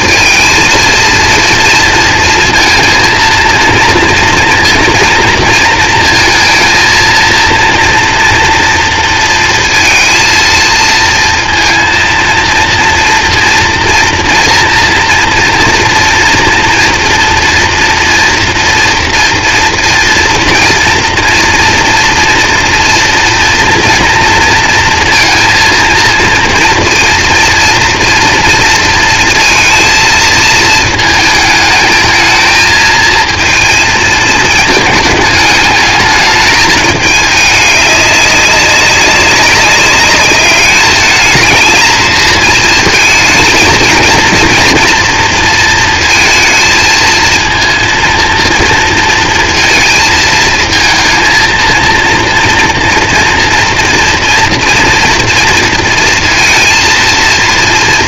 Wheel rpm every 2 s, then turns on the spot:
230, 230, 230, 230, 230, 230, 230, 230, 230, 230, 230, 230, 230, 230, 230, 220, 220, 220, 220, 200, 210, 220, 230, 230, 230, 220, 230, 230, 230.
none